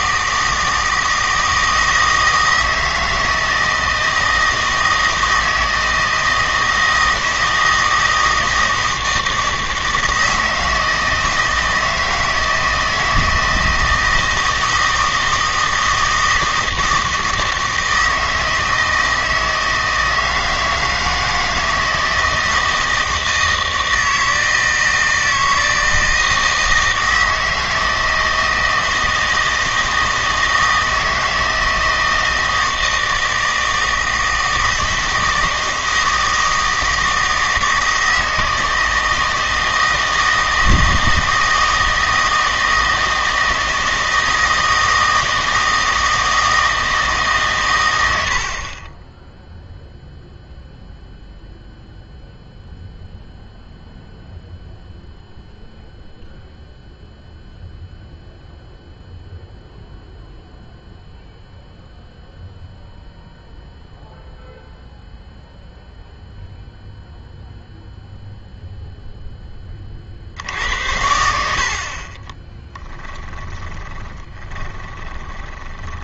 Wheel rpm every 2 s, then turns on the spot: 160, 160, 160, 160, 160, 160, 160, 160, 160, 160, 160, 160, 160, 160, 160, 160, 160, 160, 160, 160, 160, 160, 160, 160, 50, 0, 0, 0, 0, 0, 0, 0, 0, 0, 0, 70, 10, 20.
72-76